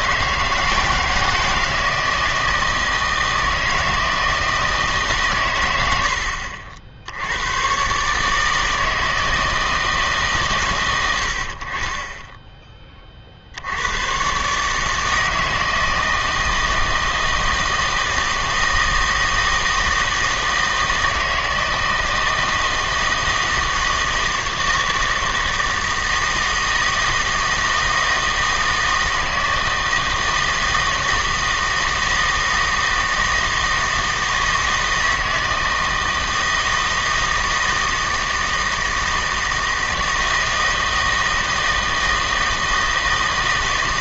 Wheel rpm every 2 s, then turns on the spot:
160, 160, 160, 60, 160, 120, 10, 140, 160, 160, 160, 160, 160, 160, 160, 160, 160, 160, 160, 160, 160, 160.
none